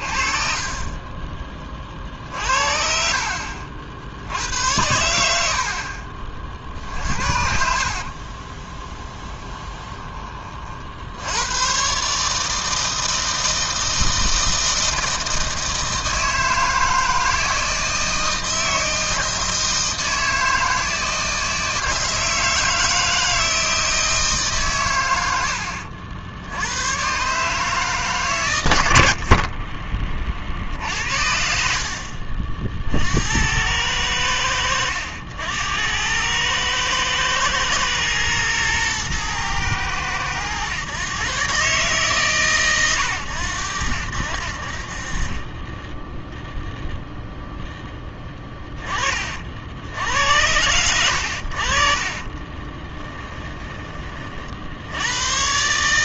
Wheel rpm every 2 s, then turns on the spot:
30, 50, 90, 50, 20, 50, 160, 160, 160, 160, 160, 160, 130, 100, 90, 60, 60, 90, 110, 120, 110, 120, 50, 0, 20, 90, 20, 70.
6-10 52-54